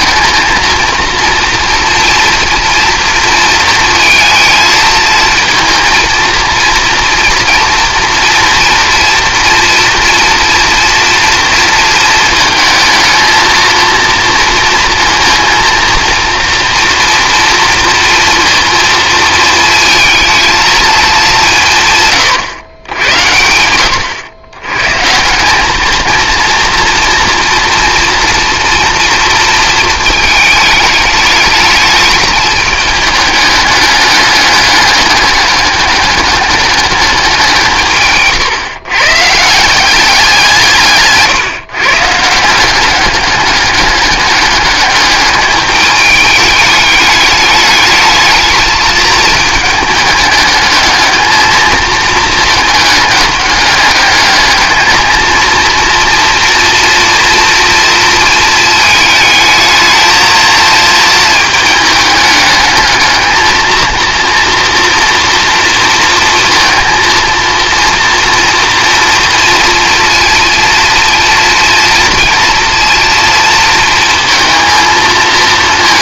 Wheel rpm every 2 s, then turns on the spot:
220, 230, 220, 230, 230, 230, 220, 230, 230, 230, 230, 110, 110, 230, 230, 220, 210, 200, 210, 130, 160, 180, 210, 210, 220, 210, 220, 220, 230, 220, 220, 210, 230, 230, 240, 230, 230, 230.
none